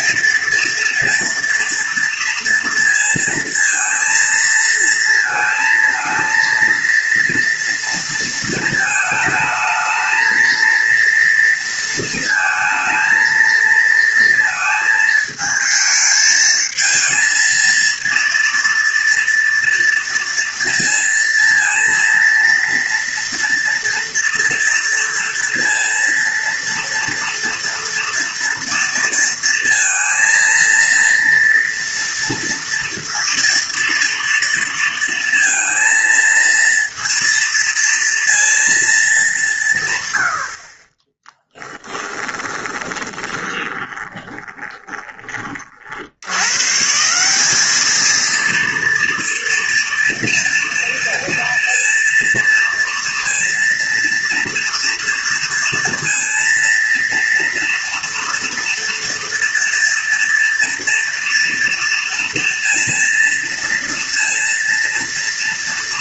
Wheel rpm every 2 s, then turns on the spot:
240, 230, 230, 230, 220, 230, 220, 220, 220, 230, 230, 230, 230, 230, 230, 230, 230, 230, 230, 210, 30, 20, 20, 170, 230, 230, 230, 230, 230, 230, 230, 240, 230.
40-46